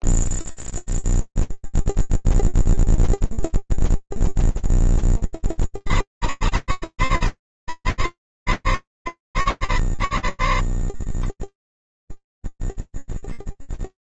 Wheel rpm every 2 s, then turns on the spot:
0, 0, 40, 130, 50, 20, 0.
none